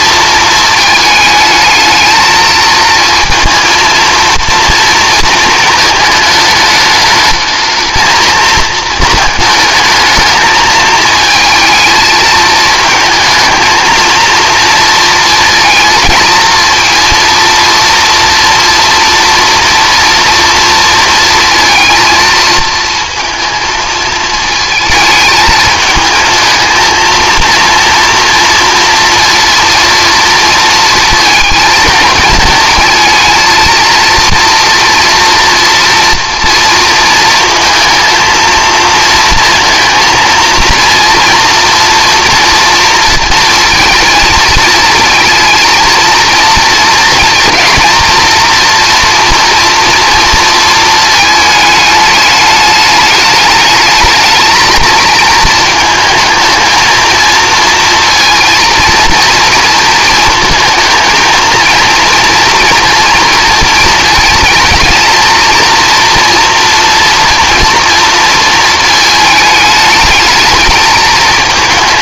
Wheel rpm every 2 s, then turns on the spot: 220, 220, 230, 210, 220, 220, 230, 230, 220, 240, 230, 220, 220, 220, 230, 230, 220, 230, 230, 220, 230, 230, 230, 230, 230, 230, 210, 220, 230, 230, 230, 230, 230, 240, 220, 220.
none